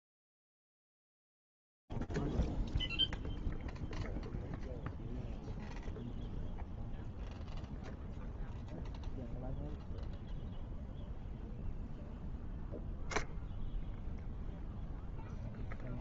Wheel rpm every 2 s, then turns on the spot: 0, 0, 0, 0, 0, 0, 0, 0.
none